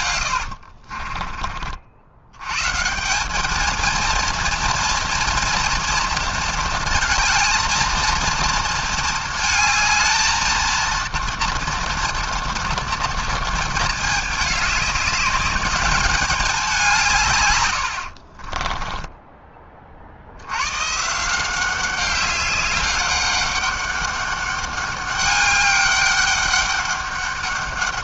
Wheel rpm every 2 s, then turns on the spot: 80, 140, 230, 230, 230, 230, 230, 210, 200, 30, 100, 200, 200, 200.
0-2 18-20